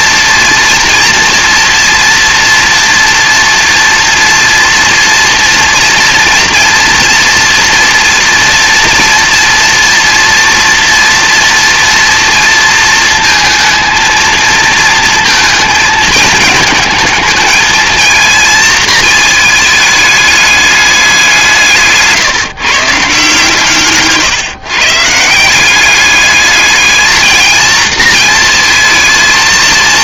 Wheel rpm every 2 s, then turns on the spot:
230, 230, 230, 240, 230, 230, 220, 230, 220, 220, 200, 150, 140, 220, 220.
none